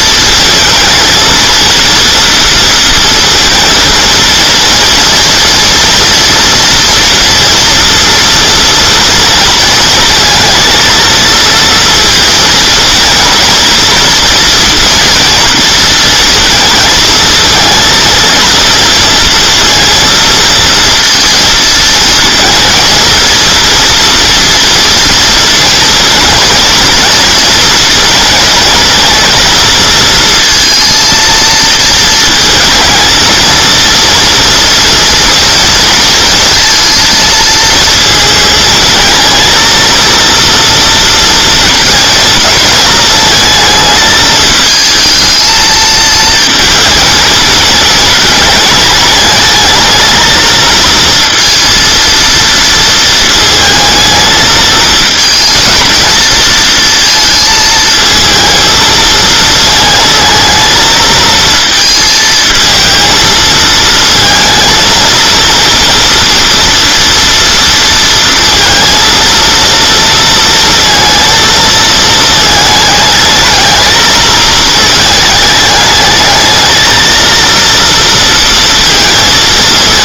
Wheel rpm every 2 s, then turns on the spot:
230, 230, 230, 230, 230, 220, 220, 230, 220, 230, 230, 220, 240, 230, 220, 230, 230, 230, 230, 220, 230, 220, 220, 220, 210, 230, 230, 220, 230, 220, 220, 220, 220, 230, 230, 230, 220, 220, 220, 230.
none